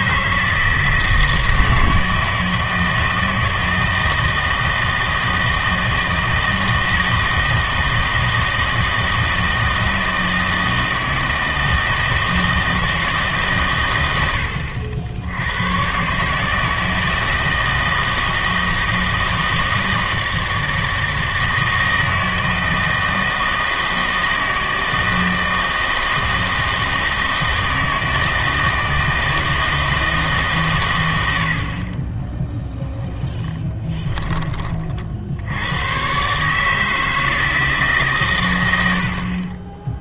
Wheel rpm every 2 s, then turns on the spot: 160, 160, 160, 160, 160, 160, 160, 80, 150, 160, 160, 160, 160, 160, 160, 130, 0, 30, 150, 100.
none